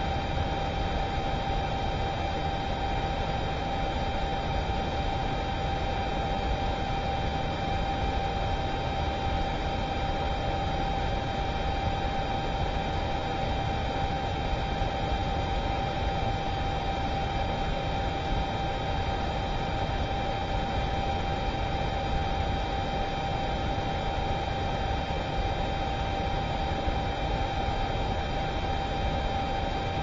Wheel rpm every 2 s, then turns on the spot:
0, 0, 0, 0, 0, 0, 0, 0, 0, 0, 0, 0, 0, 0, 0.
none